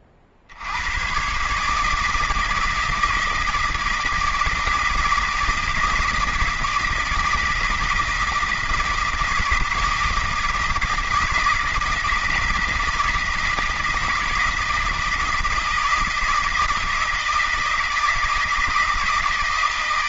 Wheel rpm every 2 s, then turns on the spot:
70, 160, 160, 160, 160, 160, 160, 160, 160, 160.
none